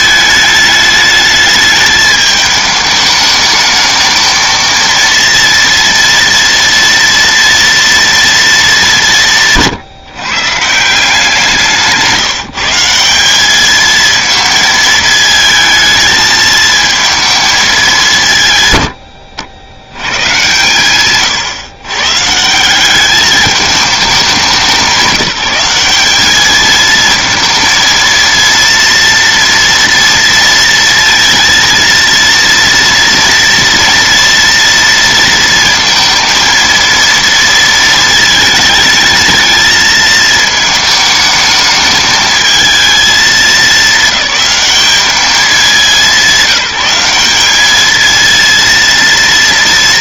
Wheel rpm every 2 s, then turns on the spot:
220, 210, 230, 230, 210, 160, 170, 220, 220, 120, 130, 170, 180, 220, 230, 230, 230, 230, 230, 220, 220, 220, 210, 190, 230.
none